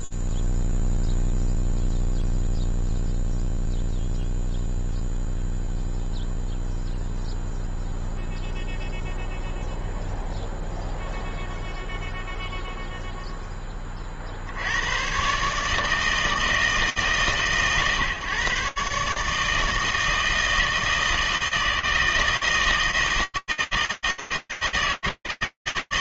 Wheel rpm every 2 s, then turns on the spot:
0, 0, 0, 0, 0, 0, 0, 70, 160, 140, 160, 160, 160.
none